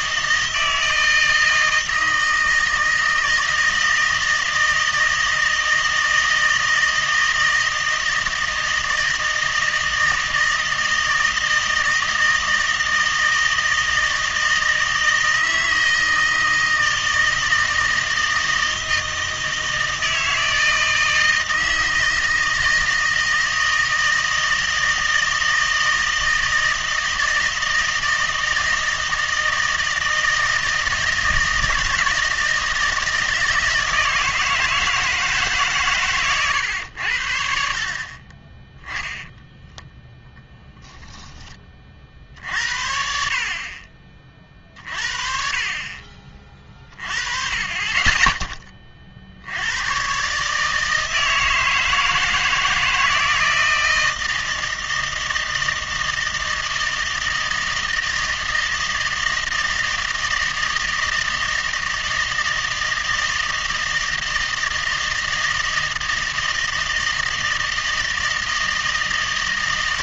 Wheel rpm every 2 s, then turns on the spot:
160, 160, 160, 160, 160, 160, 160, 160, 160, 160, 160, 160, 160, 160, 160, 160, 160, 160, 100, 20, 0, 60, 50, 30, 20, 150, 160, 160, 160, 160, 160, 160, 160, 160, 160.
38-40